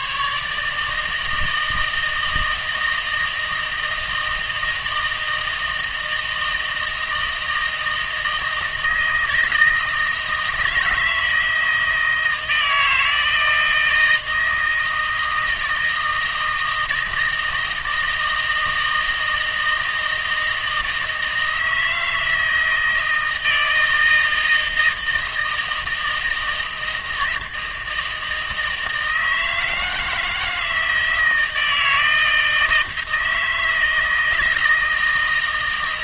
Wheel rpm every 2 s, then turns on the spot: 150, 160, 160, 160, 160, 160, 160, 160, 160, 160, 160, 160, 160, 160, 160, 160, 160, 160.
none